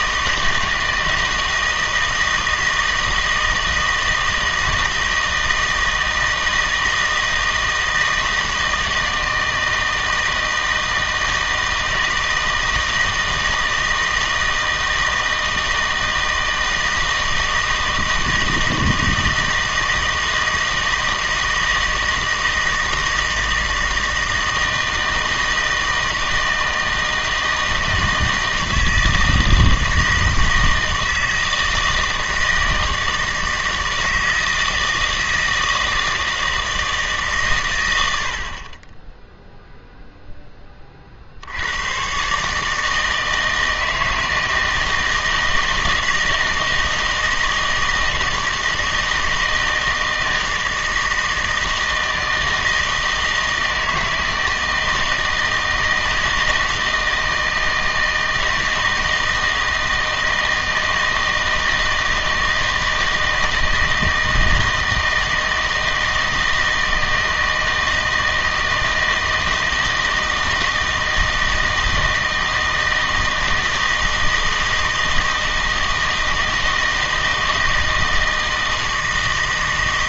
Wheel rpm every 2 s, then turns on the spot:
160, 160, 160, 160, 160, 160, 160, 160, 160, 160, 160, 160, 160, 160, 160, 160, 160, 160, 160, 40, 20, 150, 160, 160, 160, 160, 160, 160, 160, 160, 160, 160, 160, 160, 160, 160, 160, 160, 160, 160.
none